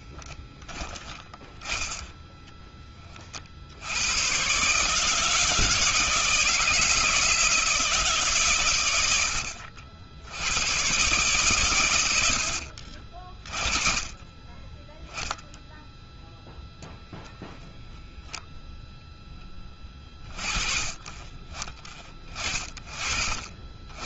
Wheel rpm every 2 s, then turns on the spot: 10, 10, 130, 160, 110, 110, 60, 10, 10, 10, 20, 30.
none